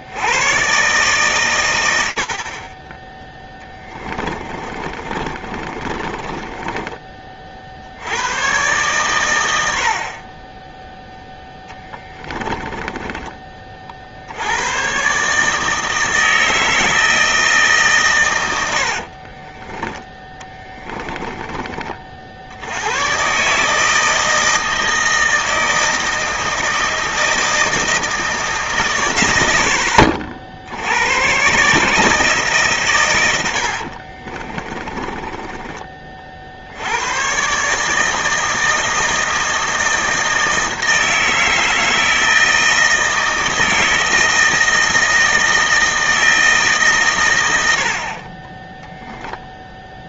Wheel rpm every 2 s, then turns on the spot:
130, 20, 30, 20, 120, 50, 10, 70, 160, 120, 10, 60, 160, 160, 160, 60, 150, 60, 50, 160, 160, 160, 160, 160, 60.
4-8 12-14 20-22 34-36